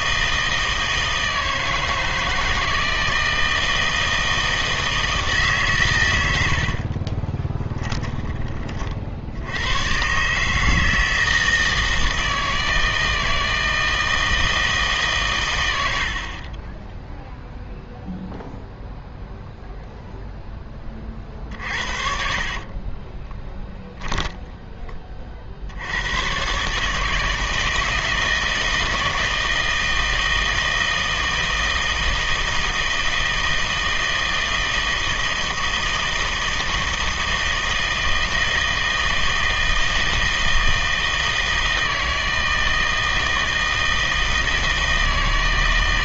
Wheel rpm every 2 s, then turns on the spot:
160, 160, 160, 60, 30, 150, 160, 150, 20, 0, 10, 40, 10, 140, 160, 160, 160, 160, 160, 160, 160, 160, 160.
6-8 16-18 22-24